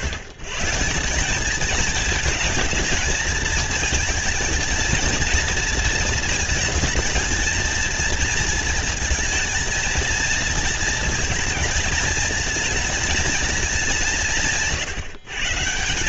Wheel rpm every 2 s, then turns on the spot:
140, 230, 230, 230, 230, 230, 220, 170.
none